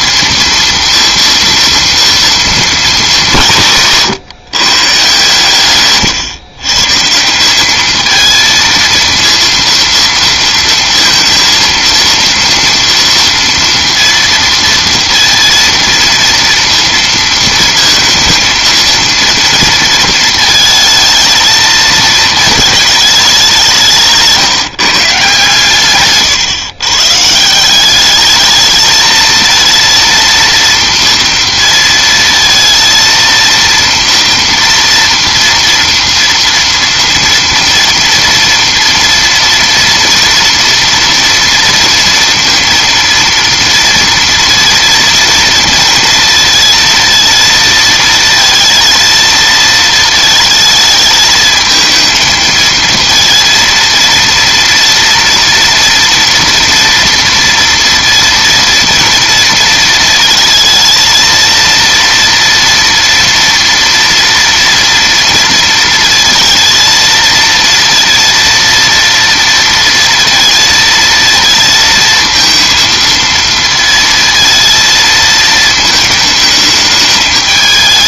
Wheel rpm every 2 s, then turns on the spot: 230, 220, 140, 140, 230, 230, 230, 230, 230, 220, 220, 220, 150, 120, 220, 230, 230, 230, 230, 230, 240, 230, 230, 230, 230, 220, 230, 230, 230, 230, 220, 230, 230, 220, 230, 230, 230, 230, 210.
none